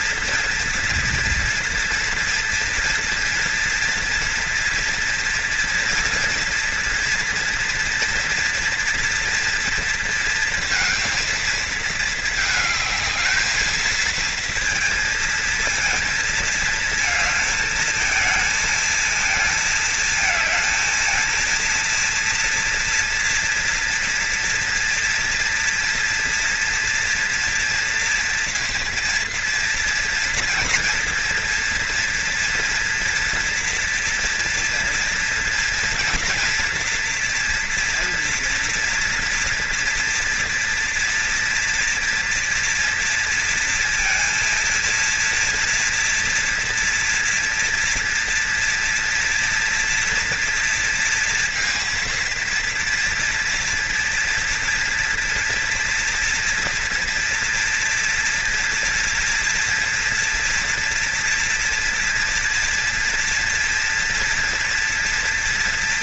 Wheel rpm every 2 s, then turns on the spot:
230, 230, 230, 230, 230, 220, 220, 230, 220, 220, 230, 230, 230, 240, 230, 230, 230, 230, 230, 230, 230, 230, 230, 230, 230, 230, 230, 230, 230, 240, 240, 230, 230.
none